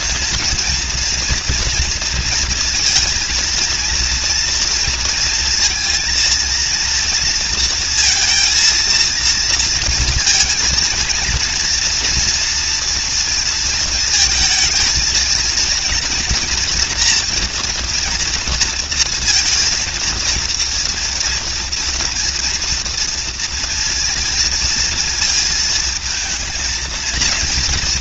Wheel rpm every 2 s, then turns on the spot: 230, 230, 230, 230, 230, 230, 230, 220, 230, 230, 230, 230, 230, 230.
none